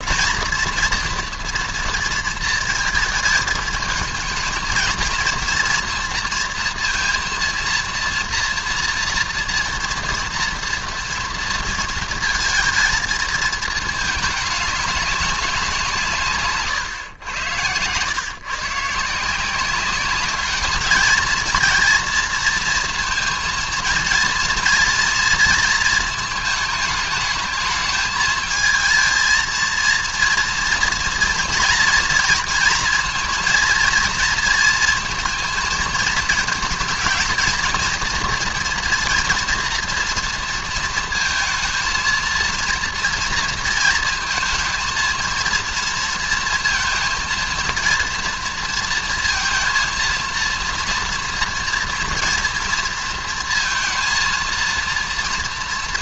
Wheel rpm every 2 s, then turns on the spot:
230, 220, 220, 230, 230, 230, 230, 200, 130, 140, 210, 230, 230, 220, 220, 230, 230, 230, 230, 240, 230, 230, 230, 230, 230, 230, 230, 230.
none